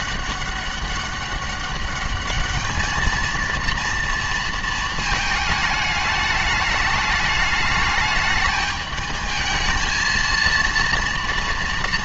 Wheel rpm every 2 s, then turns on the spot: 200, 220, 230, 210, 210, 230.
none